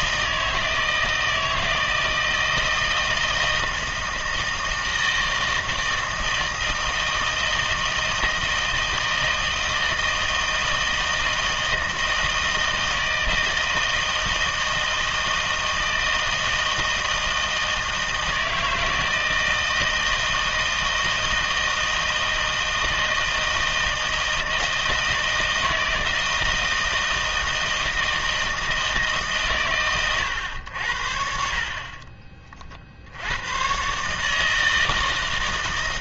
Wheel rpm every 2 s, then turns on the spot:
160, 160, 160, 160, 160, 160, 160, 160, 160, 160, 160, 160, 160, 160, 160, 90, 40, 160.
none